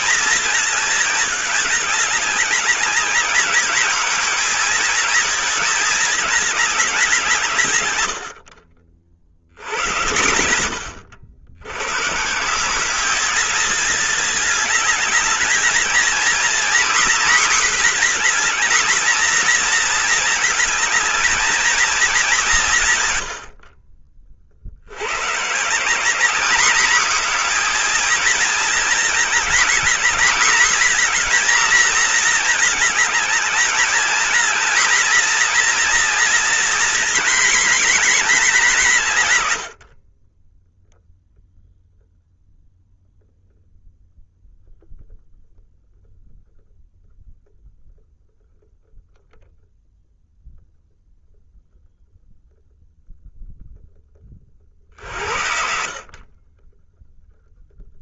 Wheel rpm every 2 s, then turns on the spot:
210, 210, 230, 170, 70, 100, 220, 220, 240, 230, 220, 100, 150, 230, 220, 230, 210, 240, 230, 100, 0, 0, 0, 0, 0, 0, 0, 50, 10.
none